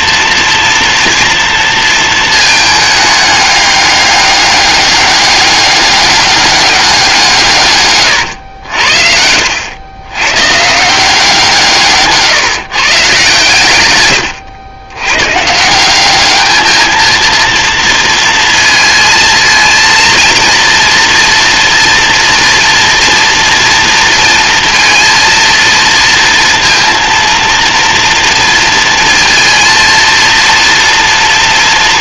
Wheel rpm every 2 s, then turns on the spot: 230, 210, 200, 190, 90, 160, 140, 100, 220, 230, 230, 240, 230, 230, 230, 230.
none